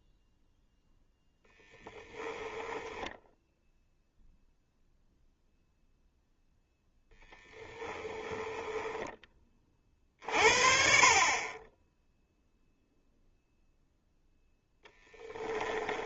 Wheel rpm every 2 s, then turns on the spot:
0, 10, 0, 0, 10, 70, 0, 10.
2-4 8-10 14-16